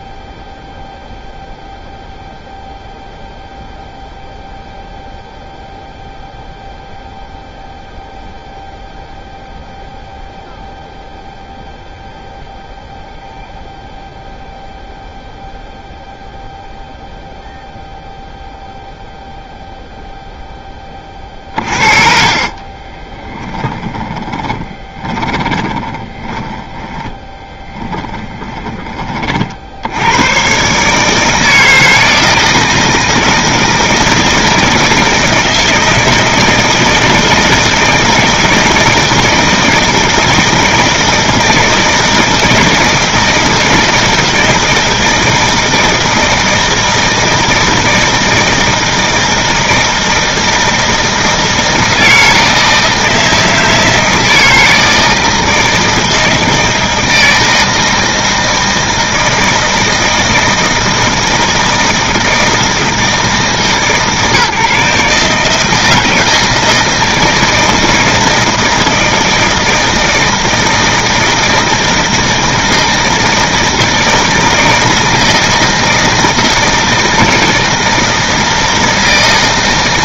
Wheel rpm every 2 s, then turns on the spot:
0, 0, 0, 0, 0, 0, 0, 0, 0, 0, 40, 20, 10, 20, 120, 160, 160, 160, 160, 160, 160, 160, 160, 160, 160, 160, 160, 160, 160, 160, 160, 150, 160, 160, 160, 160, 160, 160, 160, 160.
20-26